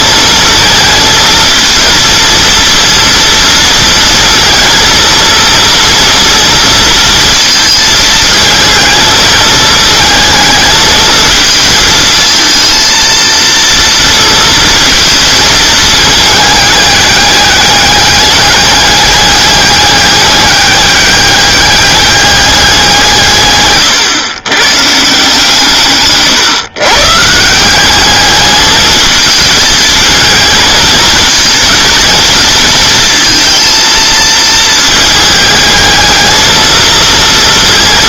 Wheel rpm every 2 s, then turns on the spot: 220, 230, 230, 230, 220, 220, 230, 220, 210, 200, 200, 180, 130, 130, 220, 220, 230, 220, 220.
none